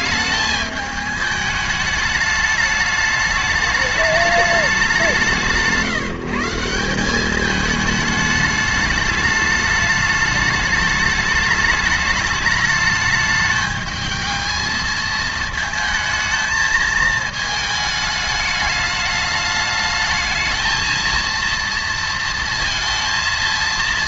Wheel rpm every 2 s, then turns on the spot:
210, 210, 200, 170, 210, 210, 210, 220, 220, 210, 220, 230.
none